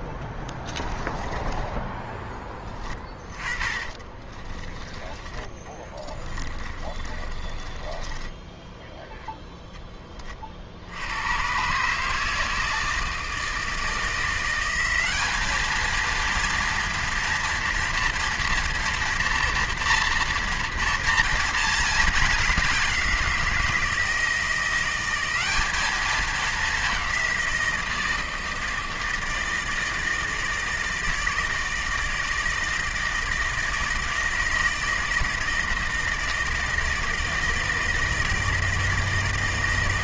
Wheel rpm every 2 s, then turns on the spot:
20, 20, 20, 20, 10, 70, 160, 180, 230, 230, 230, 190, 170, 200, 160, 160, 160, 160, 160, 160.
0-10